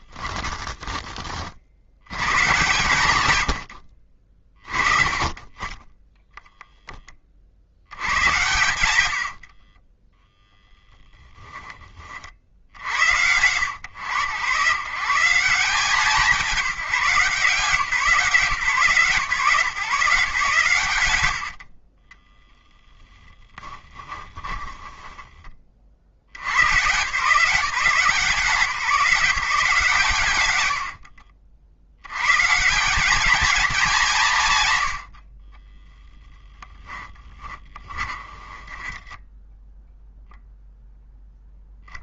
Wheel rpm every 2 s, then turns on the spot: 30, 120, 30, 10, 100, 10, 70, 130, 170, 160, 140, 0, 20, 110, 180, 100, 170, 110, 10, 10, 0.
0-2 24-26 36-40